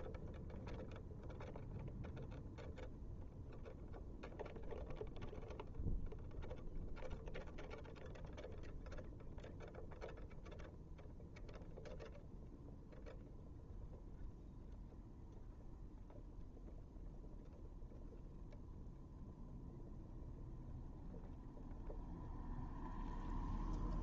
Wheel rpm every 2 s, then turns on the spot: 0, 0, 0, 0, 0, 0, 0, 0, 0, 0, 0, 0.
none